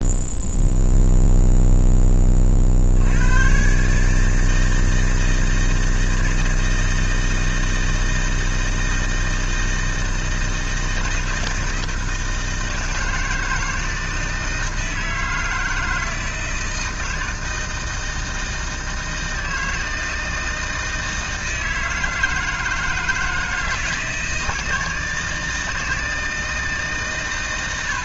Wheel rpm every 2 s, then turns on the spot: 0, 50, 160, 160, 160, 160, 160, 160, 160, 160, 160, 160, 160, 160.
none